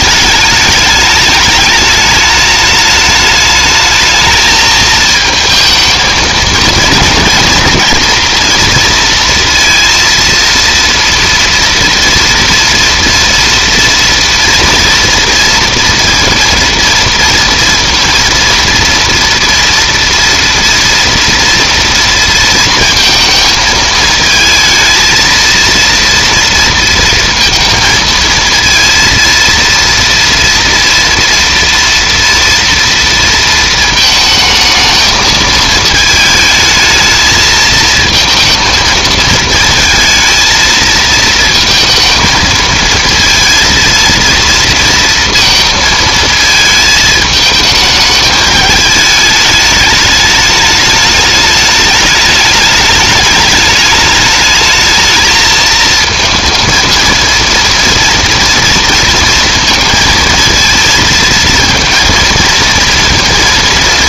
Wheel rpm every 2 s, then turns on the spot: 210, 210, 220, 230, 230, 230, 230, 230, 230, 230, 230, 230, 230, 230, 230, 230, 230, 220, 220, 220, 220, 230, 230, 220, 210, 210, 210, 220, 230, 230, 230, 230.
none